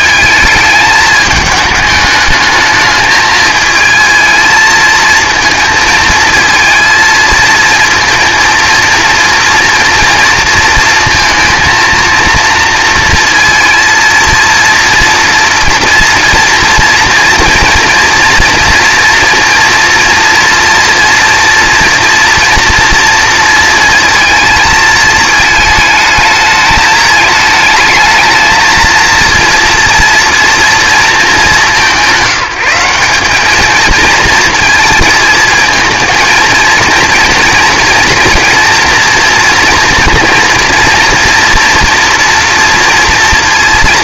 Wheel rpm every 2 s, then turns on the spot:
220, 210, 220, 230, 230, 230, 230, 230, 230, 240, 230, 230, 220, 210, 230, 230, 180, 230, 230, 240, 230, 230.
none